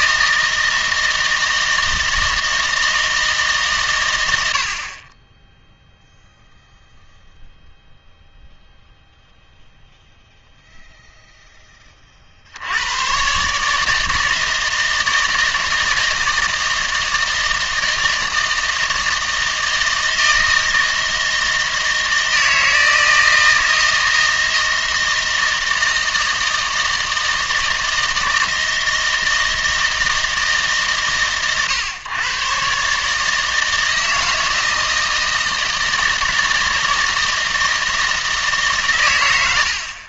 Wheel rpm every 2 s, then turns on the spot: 160, 160, 50, 0, 0, 0, 90, 160, 160, 160, 160, 160, 160, 160, 160, 140, 140, 160, 160, 130.
none